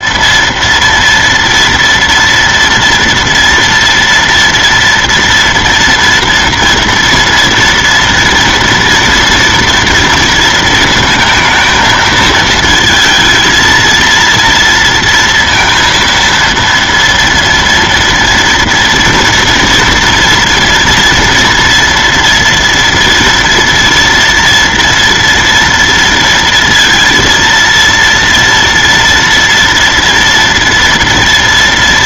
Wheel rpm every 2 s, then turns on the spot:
230, 240, 240, 230, 230, 230, 220, 230, 230, 230, 230, 230, 230, 230, 230, 230.
none